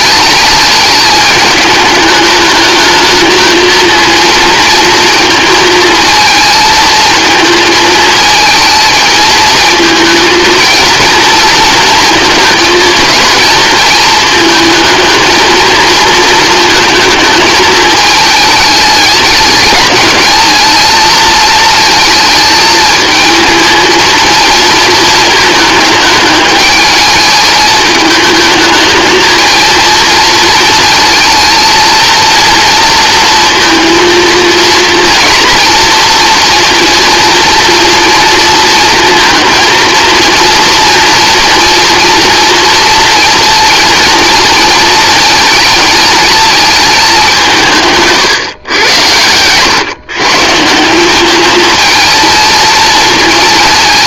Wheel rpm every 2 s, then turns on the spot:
210, 210, 230, 230, 220, 230, 230, 220, 230, 220, 220, 220, 220, 220, 220, 230, 230, 230, 230, 230, 230, 230, 230, 220, 130, 170, 220.
none